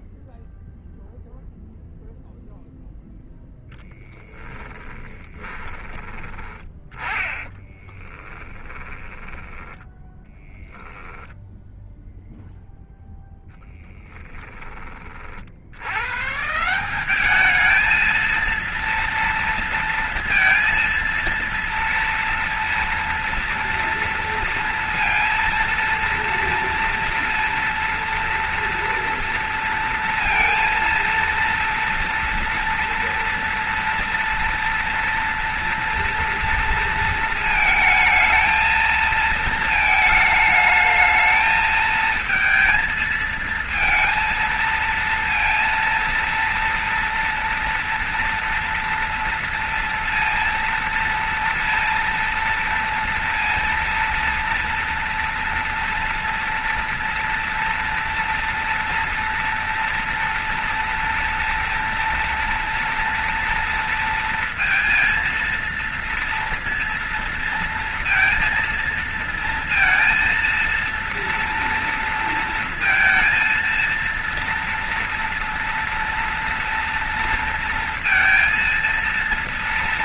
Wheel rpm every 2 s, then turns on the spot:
0, 0, 20, 20, 10, 10, 0, 10, 150, 230, 230, 240, 230, 230, 230, 230, 230, 240, 240, 220, 220, 230, 230, 230, 230, 230, 230, 230, 230, 230, 230, 230, 230, 230, 230, 230, 230, 230, 240, 230.
4-6 8-10